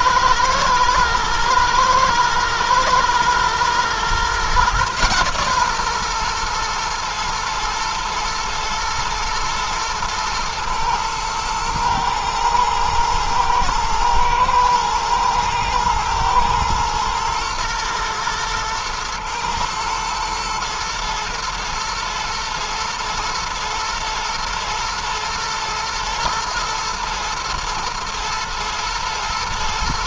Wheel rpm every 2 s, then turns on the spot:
120, 120, 130, 120, 110, 110, 110, 120, 120, 110, 120, 110, 120, 110, 120.
none